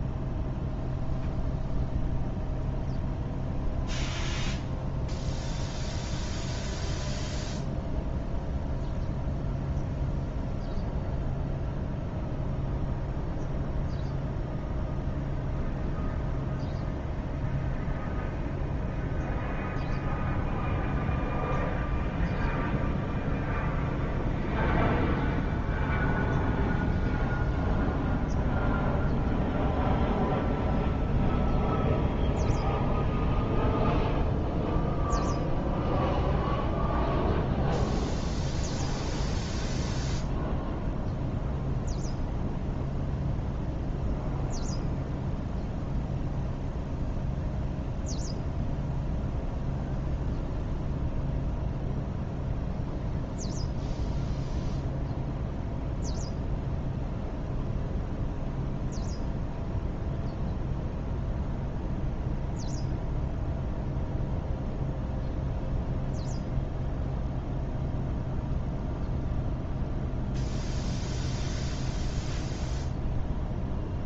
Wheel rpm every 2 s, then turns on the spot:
0, 0, 0, 0, 0, 0, 0, 0, 0, 0, 0, 0, 0, 0, 0, 0, 0, 0, 0, 0, 0, 0, 0, 0, 0, 0, 0, 0, 0, 0, 0, 0, 0, 0, 0, 0, 0.
none